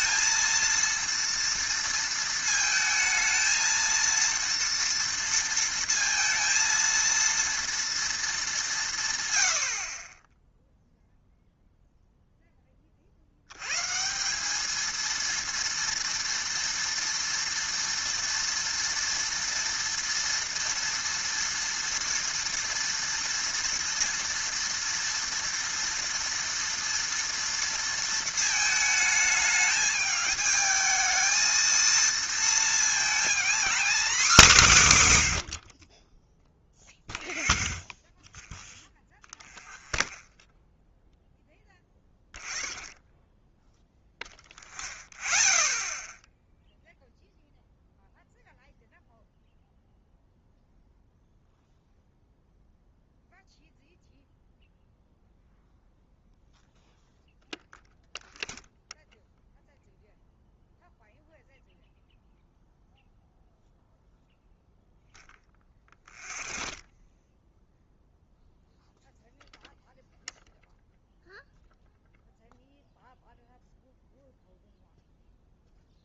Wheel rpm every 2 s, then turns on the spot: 230, 220, 230, 230, 200, 0, 20, 210, 230, 230, 230, 230, 230, 230, 220, 220, 230, 210, 0, 0, 0, 0, 0, 0, 0, 0, 0, 0, 0, 0, 0, 0, 0, 0, 0, 0, 0, 0.
none